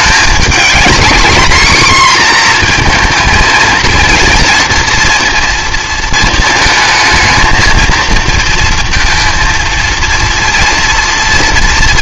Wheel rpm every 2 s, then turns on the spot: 220, 240, 230, 220, 230, 230.
none